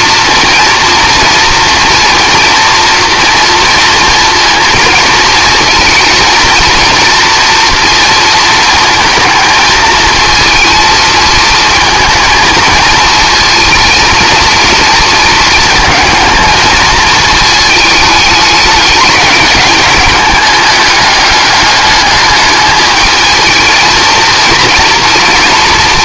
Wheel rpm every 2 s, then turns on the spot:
230, 230, 230, 230, 230, 230, 230, 230, 220, 210, 210, 210, 230.
none